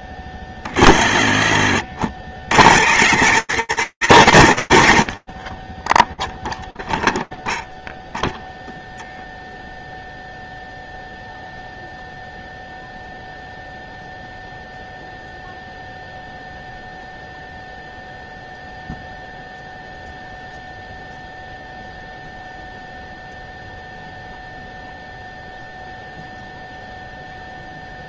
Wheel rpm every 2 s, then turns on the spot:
10, 70, 160, 0, 0, 0, 0, 0, 0, 0, 0, 0, 0, 0.
2-4